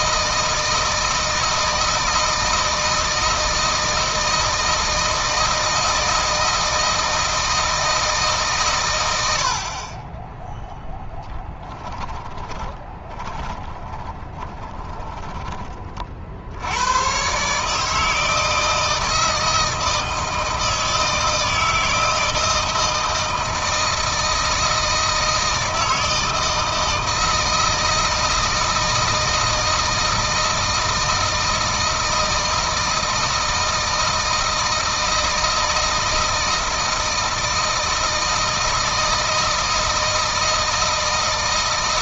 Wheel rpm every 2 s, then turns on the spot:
160, 160, 160, 160, 120, 10, 10, 20, 100, 160, 160, 160, 160, 160, 160, 160, 160, 160, 160, 160, 160.
12-16